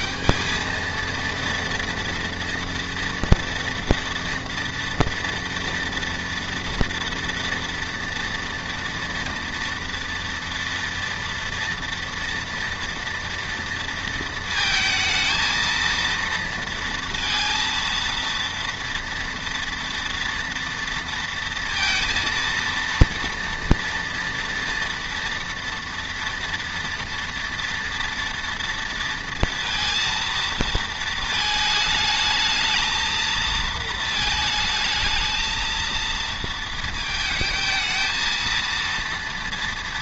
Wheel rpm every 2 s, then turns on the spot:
210, 230, 230, 230, 230, 230, 230, 220, 230, 230, 230, 230, 230, 230, 230, 230, 220, 220, 220, 230.
none